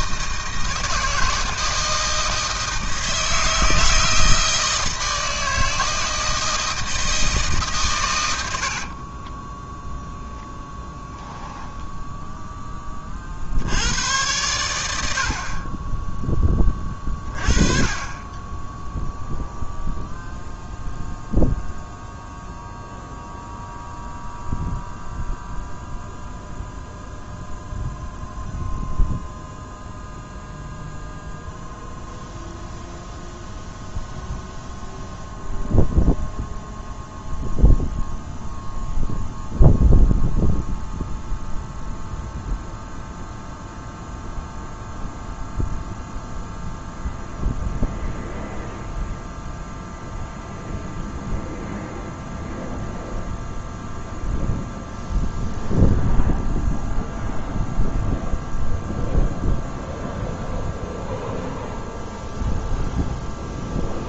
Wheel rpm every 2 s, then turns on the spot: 160, 160, 160, 160, 70, 10, 20, 90, 20, 10, 0, 0, 0, 0, 0, 0, 0, 0, 0, 0, 0, 0, 0, 0, 0, 0, 0, 0, 0, 0, 0, 0.
8-12